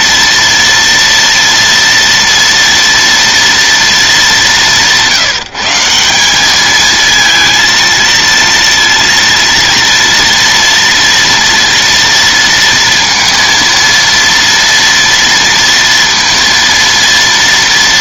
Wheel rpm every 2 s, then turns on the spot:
230, 230, 190, 210, 230, 230, 230, 230, 230.
none